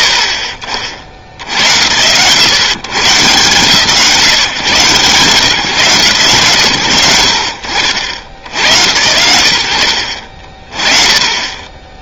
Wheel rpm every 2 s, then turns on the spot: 50, 130, 140, 80, 110, 30.
none